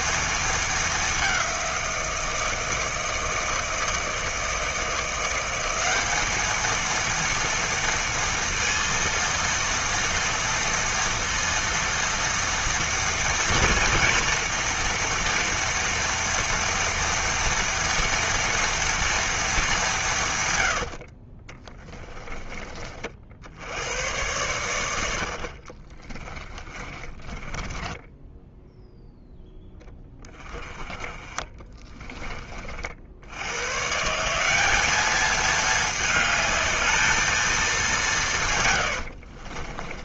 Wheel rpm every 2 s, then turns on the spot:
210, 160, 170, 230, 230, 230, 230, 230, 230, 230, 70, 50, 80, 30, 0, 20, 70, 210, 220, 80.
20-22 26-28 38-40